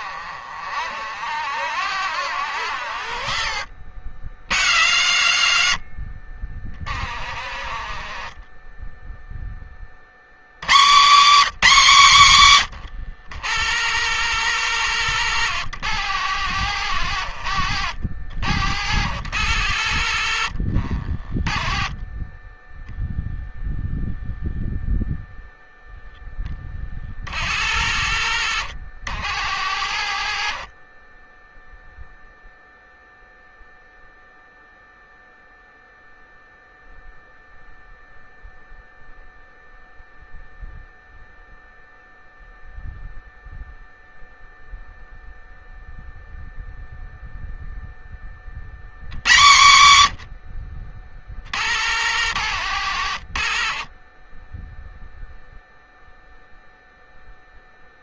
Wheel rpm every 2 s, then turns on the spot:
60, 70, 100, 40, 10, 180, 110, 110, 90, 90, 40, 10, 0, 40, 90, 30, 0, 0, 0, 0, 0, 0, 0, 0, 100, 60, 80, 0, 0.
6-10 16-22 26-32 52-54